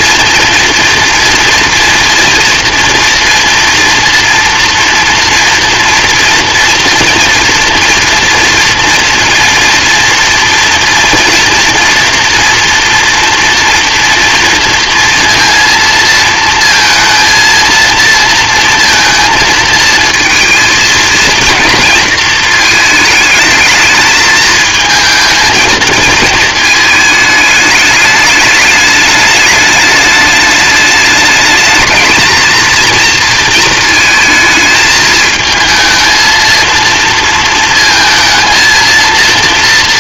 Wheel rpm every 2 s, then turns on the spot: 240, 230, 240, 230, 230, 230, 230, 230, 230, 230, 230, 220, 220, 220, 210, 210, 220, 220, 230, 230.
none